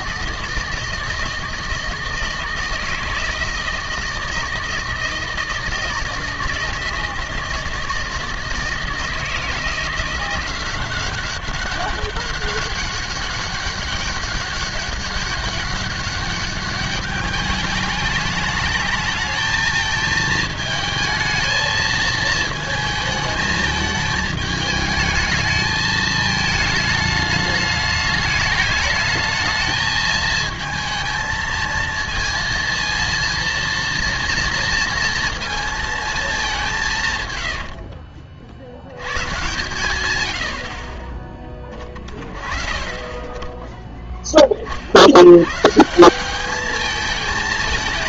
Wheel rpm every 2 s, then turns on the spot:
160, 160, 160, 160, 160, 180, 200, 200, 200, 210, 220, 220, 210, 220, 210, 220, 230, 230, 180, 50, 70, 40, 50, 210.
36-38